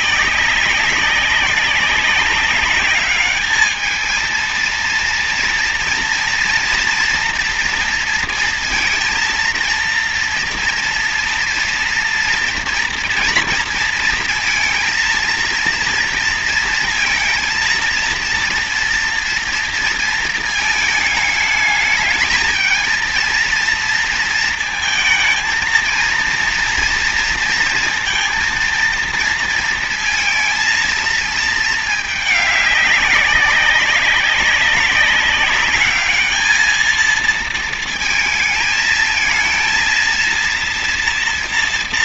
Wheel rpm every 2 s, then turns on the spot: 200, 200, 230, 230, 230, 240, 230, 230, 230, 230, 220, 220, 230, 230, 230, 230, 210, 200, 220, 220, 230.
none